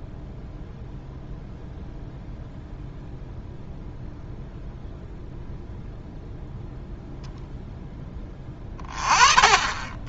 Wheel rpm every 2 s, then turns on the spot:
0, 0, 0, 0, 20.
none